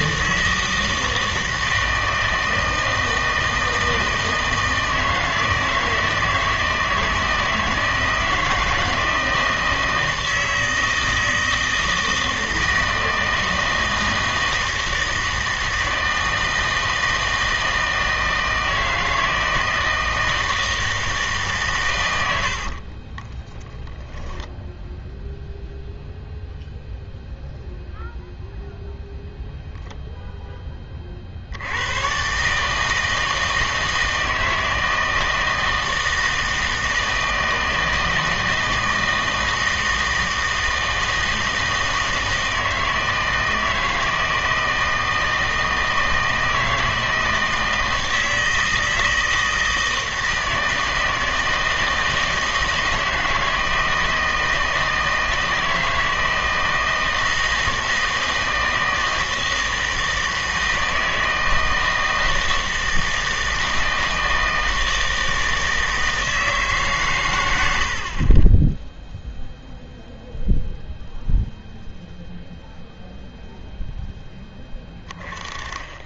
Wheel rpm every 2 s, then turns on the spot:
160, 160, 160, 160, 160, 160, 160, 160, 160, 160, 160, 60, 10, 0, 0, 10, 140, 160, 160, 160, 160, 160, 160, 160, 160, 160, 160, 160, 160, 160, 160, 160, 160, 160, 40, 0, 0, 10.
22-24